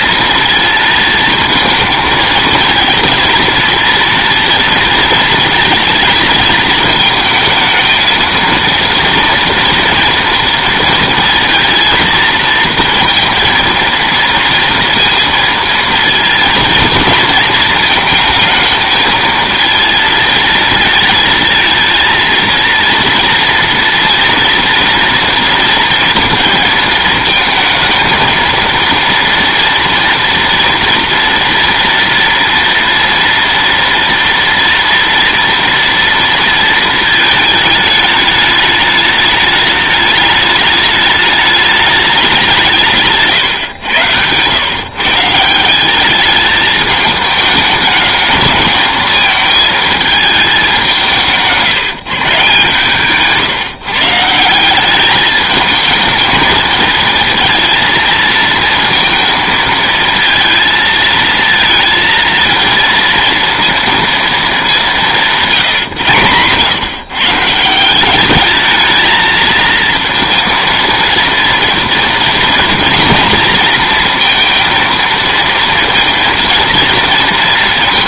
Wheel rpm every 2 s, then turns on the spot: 230, 230, 230, 220, 230, 230, 230, 230, 230, 220, 230, 230, 230, 230, 230, 230, 230, 230, 220, 210, 210, 180, 140, 210, 220, 190, 140, 190, 220, 230, 220, 230, 210, 130, 210, 230, 240, 230, 230.
none